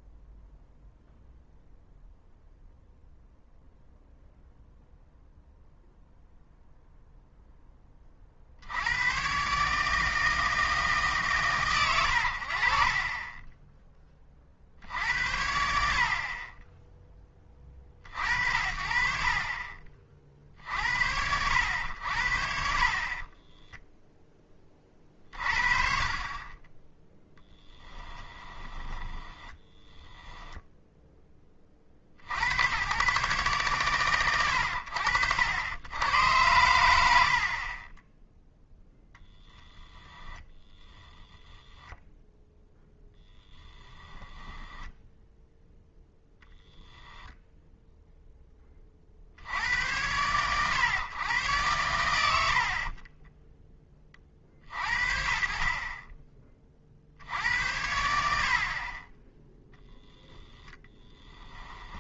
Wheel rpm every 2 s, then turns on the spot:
0, 0, 0, 0, 60, 150, 50, 60, 20, 60, 30, 50, 10, 0, 10, 0, 90, 50, 110, 0, 10, 0, 10, 0, 20, 100, 50, 50, 20, 50, 10.
28-30 40-42 60-62